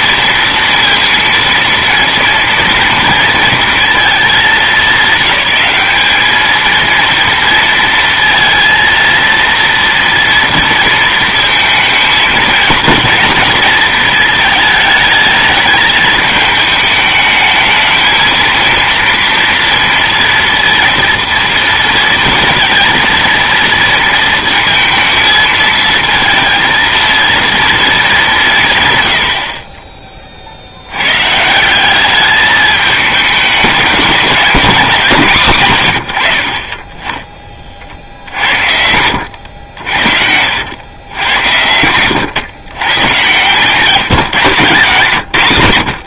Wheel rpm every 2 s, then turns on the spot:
230, 230, 200, 220, 230, 230, 210, 220, 220, 230, 230, 230, 230, 230, 150, 60, 210, 190, 50, 70, 90, 100, 150.
none